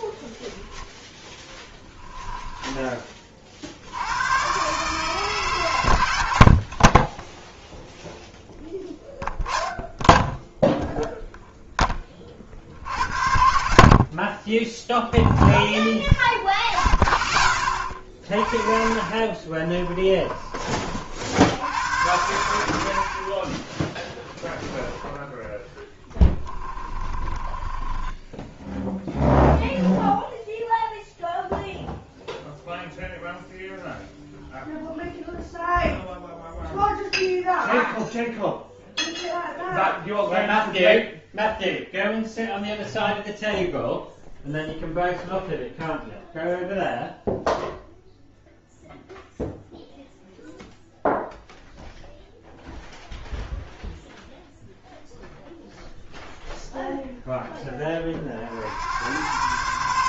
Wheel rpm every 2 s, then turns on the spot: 0, 20, 140, 40, 0, 0, 70, 20, 0, 40, 30, 80, 0, 20, 10, 0, 0, 0, 0, 0, 0, 0, 0, 0, 0, 0, 0, 0, 0, 70.
18-20 26-28